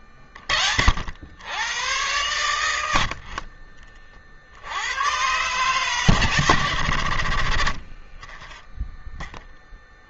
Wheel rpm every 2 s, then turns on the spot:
40, 80, 60, 120, 10.
8-10